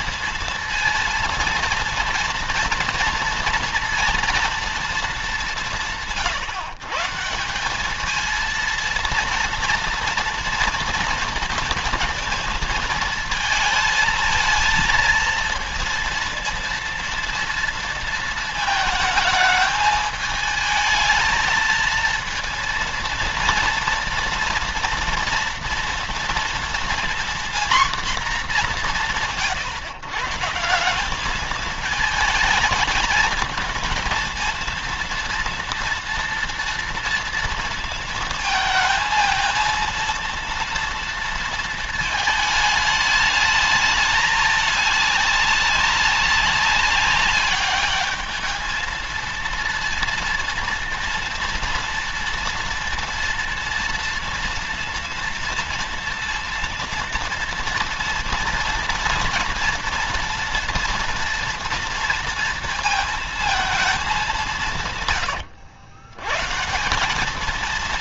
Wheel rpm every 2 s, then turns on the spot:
230, 230, 220, 150, 230, 230, 220, 230, 230, 220, 220, 230, 230, 240, 190, 190, 220, 230, 230, 220, 230, 210, 200, 200, 220, 230, 230, 230, 230, 230, 230, 230, 130, 200.
64-66